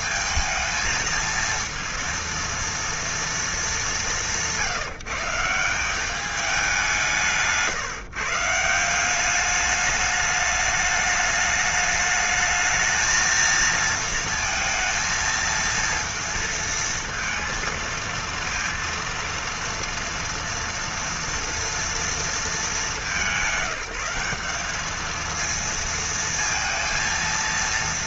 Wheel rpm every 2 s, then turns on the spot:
220, 230, 160, 200, 170, 210, 220, 230, 230, 230, 230, 200, 200, 230.
none